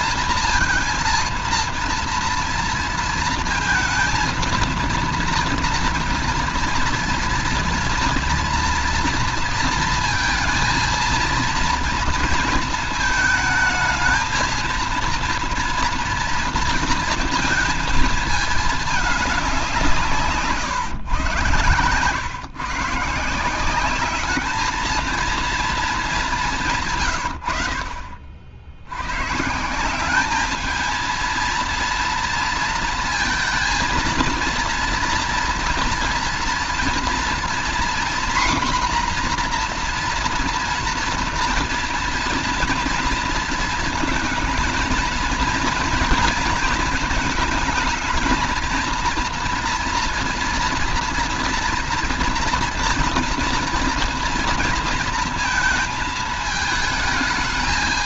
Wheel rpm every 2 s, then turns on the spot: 230, 230, 230, 230, 230, 230, 230, 220, 230, 220, 150, 140, 210, 190, 60, 210, 230, 230, 230, 250, 240, 240, 220, 220, 220, 230, 230, 230, 220.
none